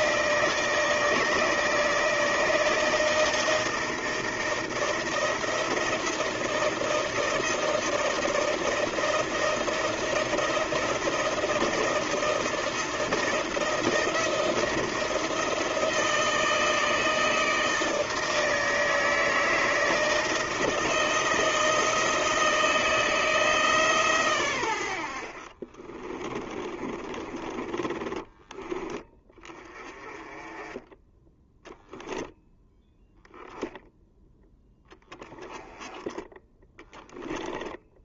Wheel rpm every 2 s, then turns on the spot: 160, 160, 160, 160, 170, 170, 170, 170, 160, 160, 160, 160, 80, 30, 20, 10, 0, 10, 10.
26-28 36-38